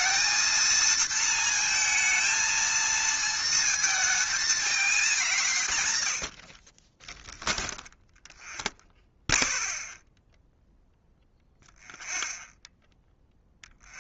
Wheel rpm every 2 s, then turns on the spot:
230, 230, 220, 50, 0, 0, 0.
none